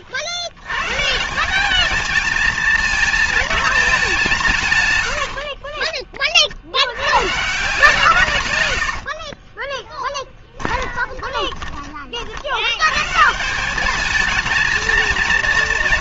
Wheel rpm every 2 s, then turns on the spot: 130, 230, 140, 90, 80, 10, 110, 220.
8-12